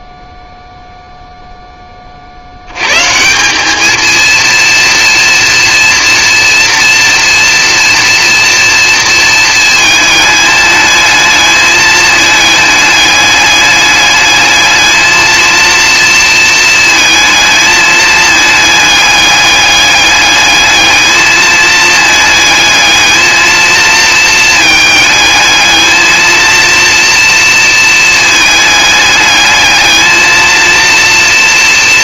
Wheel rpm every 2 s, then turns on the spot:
0, 130, 230, 230, 230, 210, 210, 220, 220, 210, 210, 220, 220, 230, 210, 230.
none